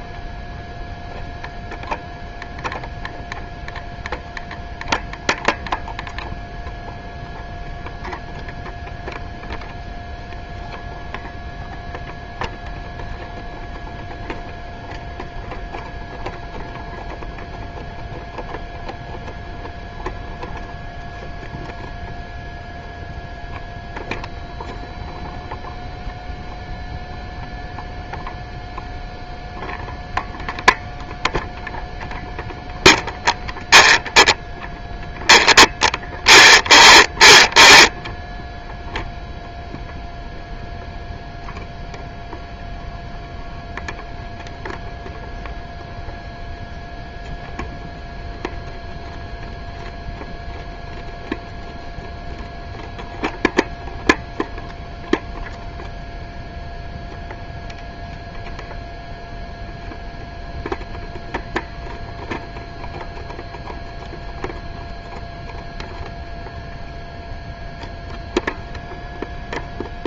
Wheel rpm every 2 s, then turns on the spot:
0, 0, 0, 0, 0, 0, 0, 0, 0, 0, 0, 0, 0, 0, 0, 0, 0, 0, 0, 0, 0, 0, 0, 0, 0, 0, 0, 0, 0, 0, 0, 0, 0, 0, 0.
none